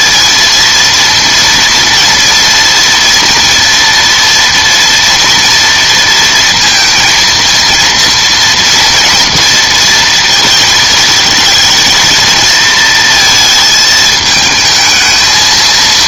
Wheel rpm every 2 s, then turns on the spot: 230, 230, 230, 230, 230, 220, 230, 220.
none